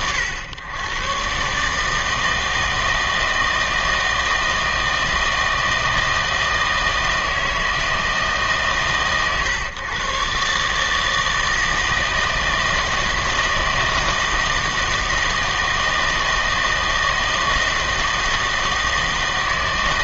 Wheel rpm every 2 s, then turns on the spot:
110, 160, 160, 160, 140, 140, 160, 160, 160, 160.
none